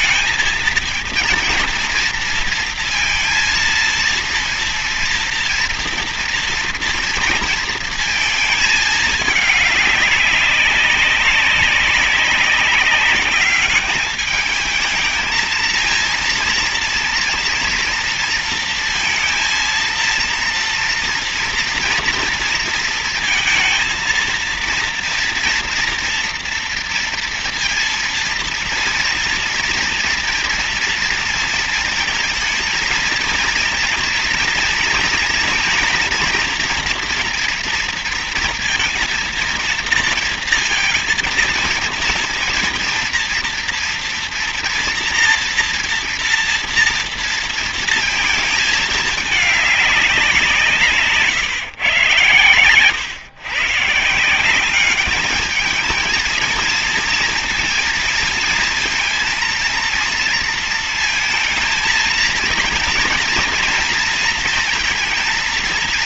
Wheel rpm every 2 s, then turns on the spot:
230, 230, 230, 230, 220, 200, 200, 210, 230, 230, 230, 230, 230, 230, 230, 230, 230, 230, 240, 230, 230, 230, 230, 230, 220, 180, 120, 170, 220, 230, 230, 220, 230.
none